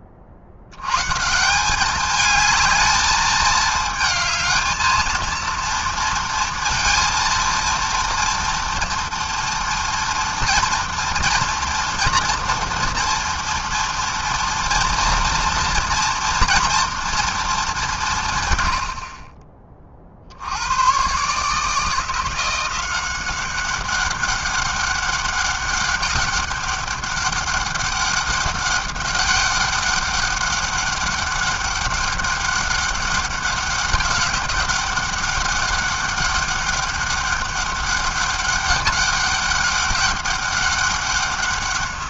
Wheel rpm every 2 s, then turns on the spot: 80, 220, 220, 230, 230, 230, 230, 240, 230, 120, 70, 170, 200, 200, 200, 200, 200, 200, 200, 200, 200.
none